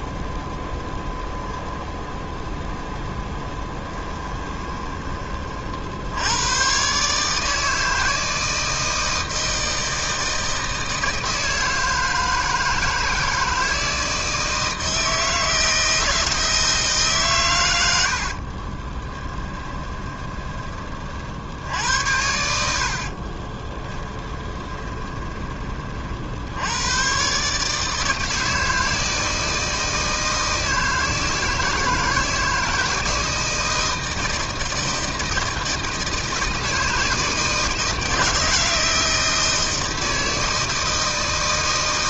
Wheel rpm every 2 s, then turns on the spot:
0, 0, 20, 130, 160, 160, 160, 160, 150, 20, 40, 60, 20, 110, 160, 160, 160, 160, 160, 160, 160.
18-20 22-26